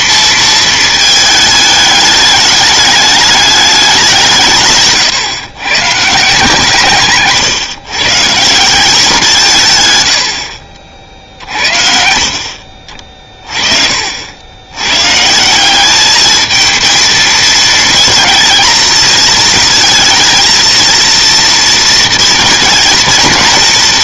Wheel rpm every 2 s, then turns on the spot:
220, 210, 160, 150, 170, 60, 50, 90, 220, 220, 230, 220.
12-14